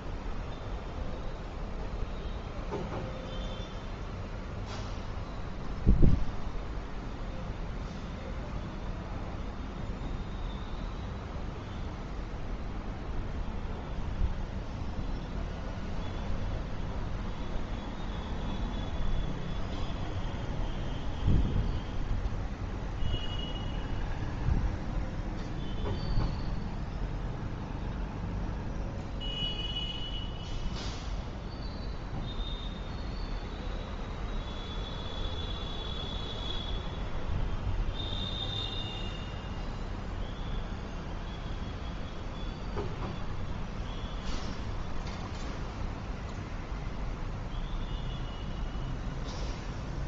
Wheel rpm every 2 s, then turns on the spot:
0, 0, 0, 0, 0, 0, 0, 0, 0, 0, 0, 0, 0, 0, 0, 0, 0, 0, 0, 0, 0, 0, 0, 0, 0.
none